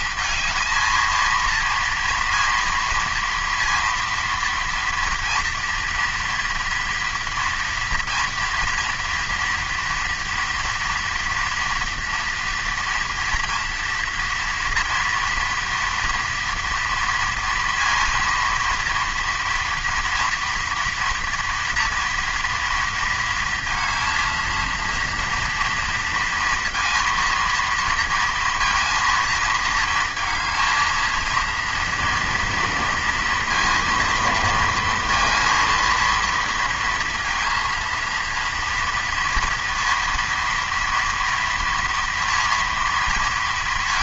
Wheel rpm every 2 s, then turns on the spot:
230, 230, 230, 230, 240, 230, 230, 230, 240, 230, 230, 230, 230, 230, 230, 220, 230, 230, 230, 230, 230, 230.
none